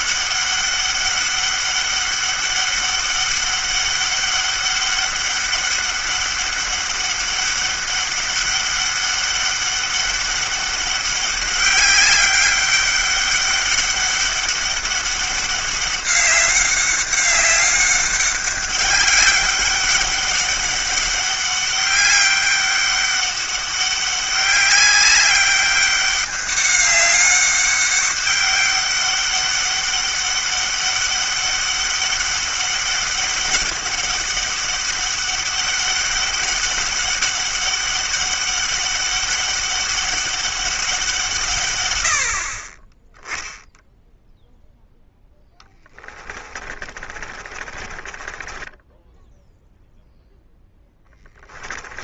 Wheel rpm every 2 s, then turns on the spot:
200, 200, 200, 200, 200, 200, 200, 200, 200, 200, 200, 200, 200, 200, 200, 200, 200, 200, 200, 200, 190, 40, 0, 30, 20, 10.
46-52